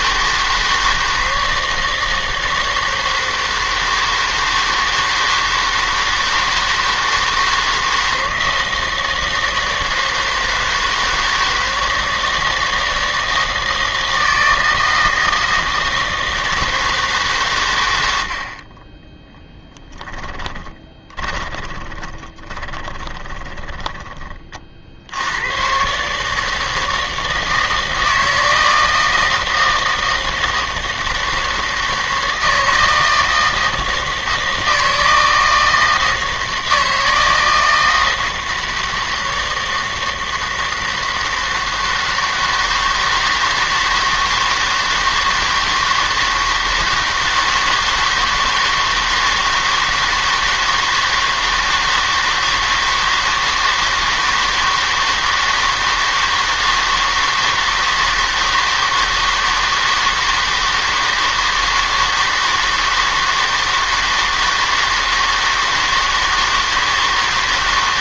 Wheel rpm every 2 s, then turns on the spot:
160, 160, 160, 160, 160, 160, 160, 160, 160, 30, 20, 20, 40, 160, 160, 160, 160, 160, 160, 160, 160, 160, 160, 160, 160, 160, 160, 160, 160, 160, 160, 160, 160, 160.
20-24